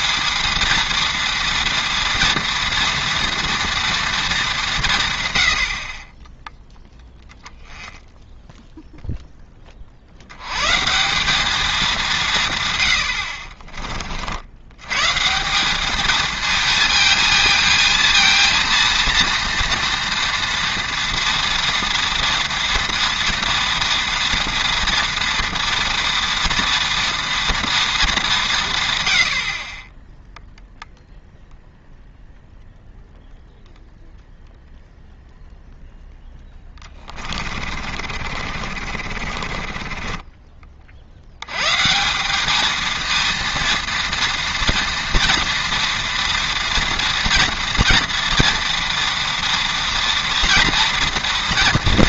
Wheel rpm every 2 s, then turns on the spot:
230, 230, 200, 0, 0, 120, 120, 80, 220, 230, 230, 230, 230, 230, 150, 0, 0, 0, 10, 40, 30, 210, 230, 230, 230, 240.
36-40